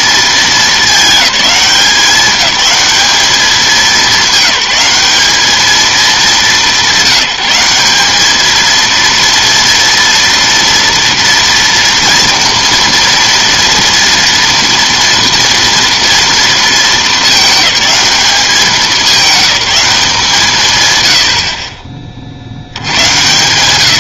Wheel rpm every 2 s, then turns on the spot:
220, 210, 200, 190, 230, 230, 230, 230, 220, 200, 120, 90.
none